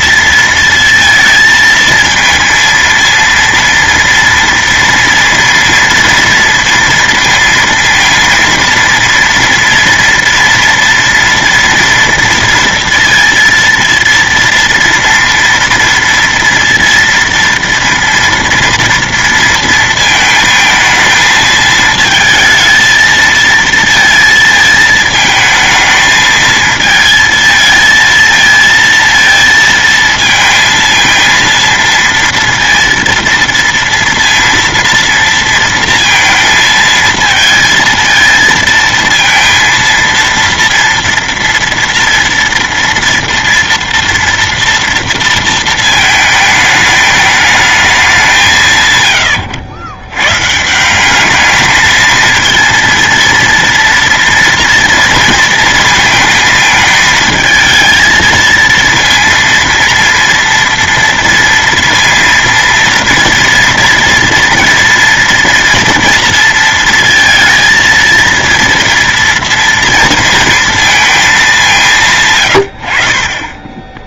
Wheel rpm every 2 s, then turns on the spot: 230, 230, 230, 230, 230, 230, 230, 230, 230, 230, 220, 220, 220, 220, 230, 230, 230, 230, 230, 230, 230, 230, 230, 210, 140, 160, 230, 230, 220, 230, 240, 230, 230, 230, 230, 230, 100.
none